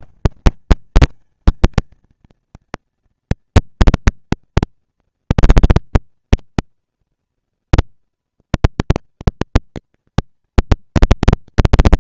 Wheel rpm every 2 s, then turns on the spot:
190, 230, 240, 230, 230, 230.
none